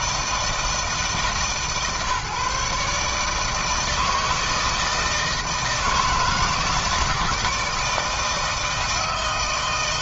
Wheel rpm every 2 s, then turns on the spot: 160, 140, 160, 160, 160.
none